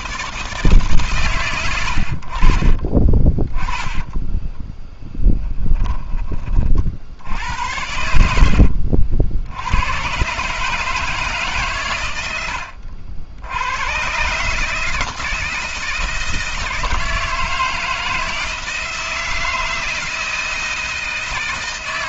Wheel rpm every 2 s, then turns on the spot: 140, 40, 10, 50, 70, 150, 80, 150, 160, 160, 160.
2-4